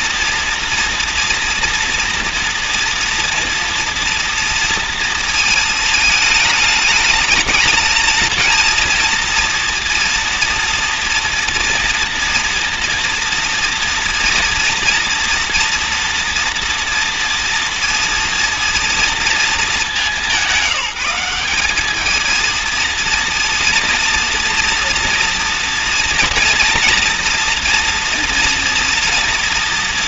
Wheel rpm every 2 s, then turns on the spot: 230, 240, 230, 210, 220, 230, 230, 230, 230, 230, 200, 230, 230, 240, 230.
none